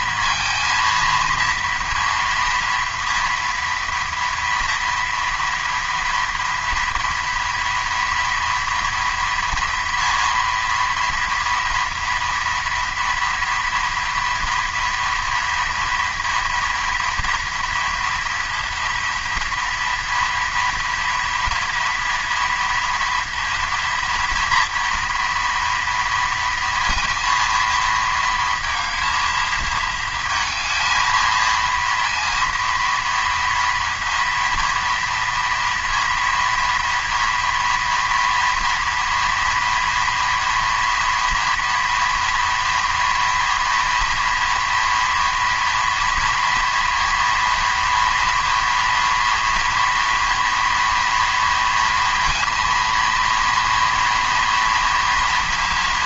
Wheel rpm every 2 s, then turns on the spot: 230, 230, 230, 230, 230, 240, 230, 230, 230, 230, 230, 230, 230, 230, 230, 220, 230, 230, 230, 230, 230, 230, 240, 240, 230, 230, 230, 230.
none